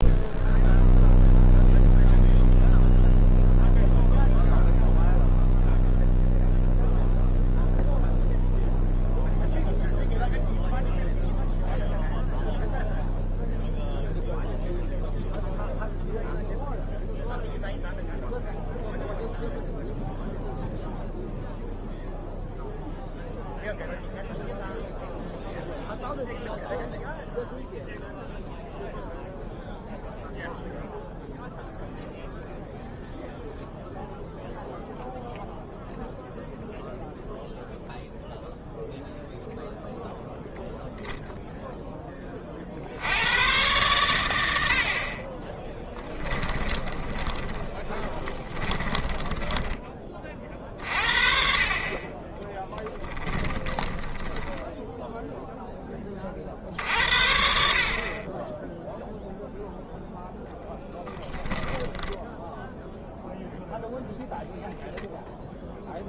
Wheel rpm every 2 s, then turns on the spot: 0, 0, 0, 0, 0, 0, 0, 0, 0, 0, 0, 0, 0, 0, 0, 0, 0, 0, 0, 0, 0, 40, 80, 10, 20, 40, 10, 10, 60, 10, 0, 0, 0.
46-50 52-56